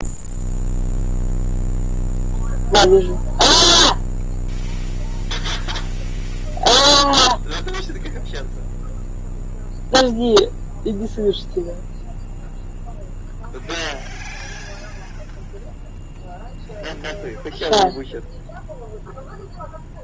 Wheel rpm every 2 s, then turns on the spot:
0, 0, 0, 0, 0, 0, 0, 0, 0, 0.
none